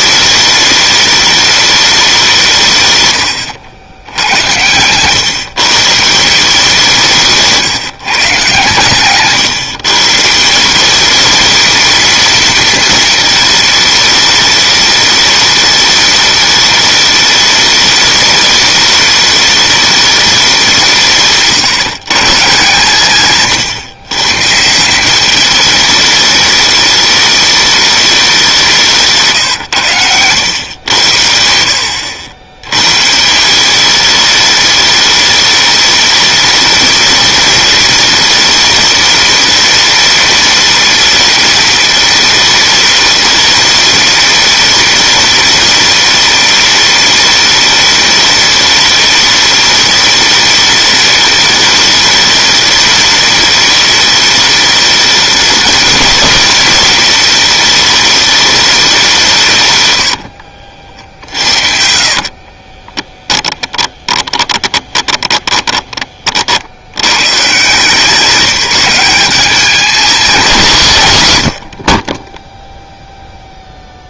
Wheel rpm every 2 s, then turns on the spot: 210, 160, 110, 170, 130, 180, 230, 210, 210, 210, 180, 150, 160, 210, 180, 90, 100, 210, 210, 210, 210, 210, 210, 210, 210, 210, 210, 210, 210, 200, 60, 20, 20, 60, 190, 170, 0.
60-66